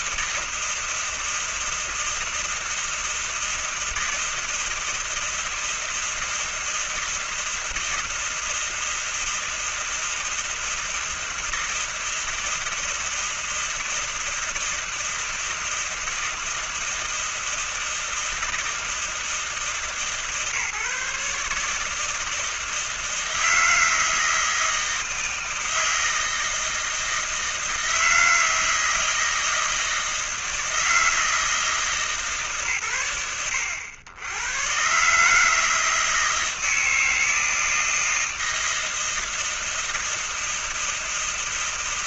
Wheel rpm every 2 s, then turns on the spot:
160, 160, 160, 160, 160, 160, 160, 160, 160, 160, 150, 160, 160, 160, 160, 160, 150, 100, 160, 160, 160.
none